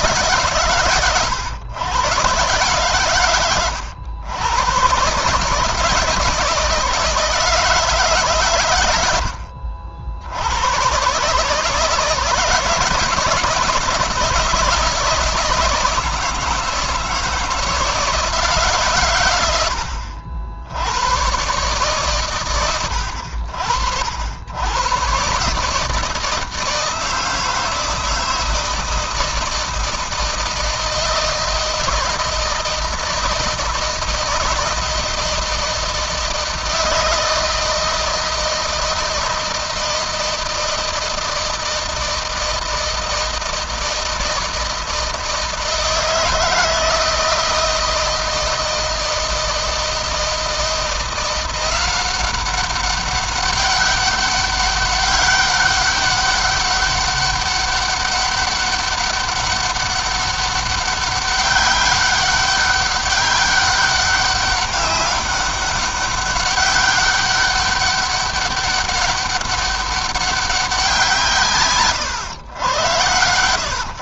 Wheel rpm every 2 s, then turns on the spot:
140, 120, 130, 160, 110, 110, 160, 160, 160, 140, 70, 100, 110, 160, 160, 160, 160, 160, 160, 160, 160, 160, 160, 160, 160, 170, 190, 200, 200, 200, 200, 200, 200, 200, 200, 180, 110.
none